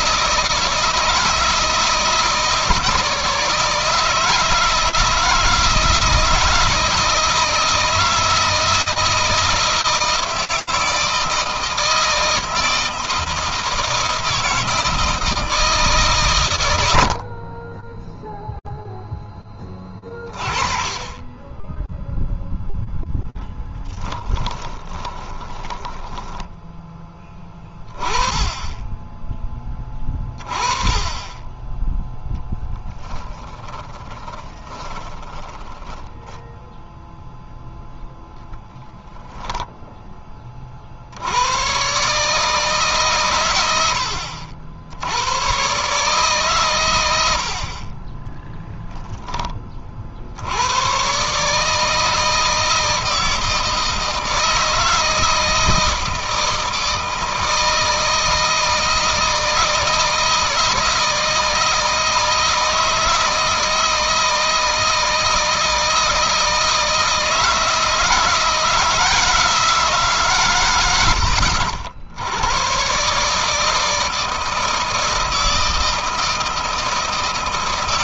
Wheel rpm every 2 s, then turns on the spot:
160, 160, 160, 160, 160, 160, 160, 160, 90, 0, 40, 0, 20, 10, 10, 20, 10, 20, 10, 10, 50, 140, 80, 120, 10, 110, 160, 160, 160, 160, 160, 160, 160, 160, 170, 100, 130, 160, 170.
24-26 32-36 38-40